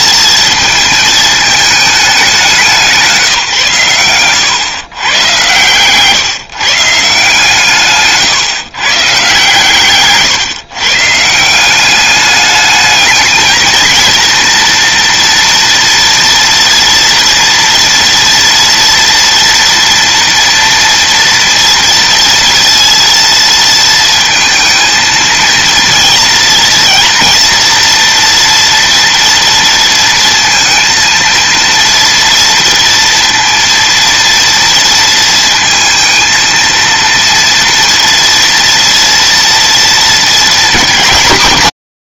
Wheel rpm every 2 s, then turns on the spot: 220, 170, 130, 140, 130, 130, 210, 230, 230, 230, 230, 230, 230, 230, 230, 230, 230, 230, 230, 240, 220.
none